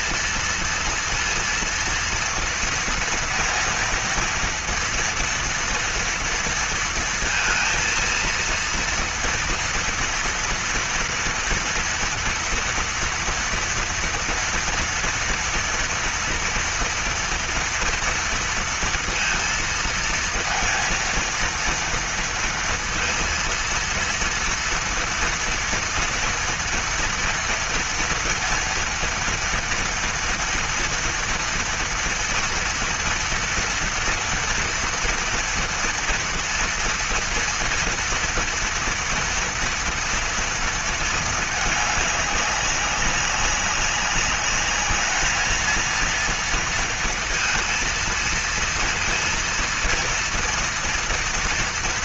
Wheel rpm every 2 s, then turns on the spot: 230, 230, 230, 230, 230, 230, 230, 230, 230, 230, 230, 230, 230, 230, 230, 230, 230, 230, 230, 230, 230, 200, 200, 230, 230, 230.
none